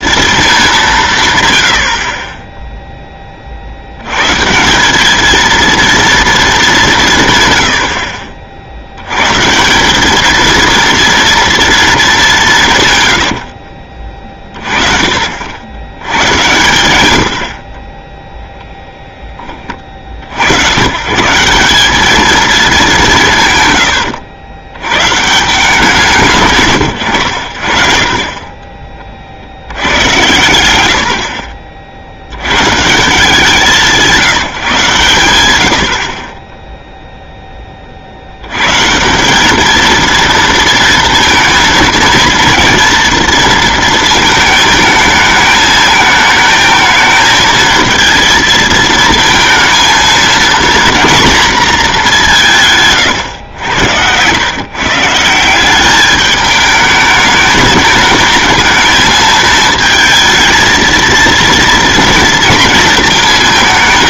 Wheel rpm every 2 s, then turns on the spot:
210, 10, 180, 200, 70, 230, 140, 50, 100, 0, 100, 210, 100, 120, 20, 90, 130, 150, 10, 130, 230, 230, 220, 220, 230, 230, 150, 130, 220, 230, 230, 230.
none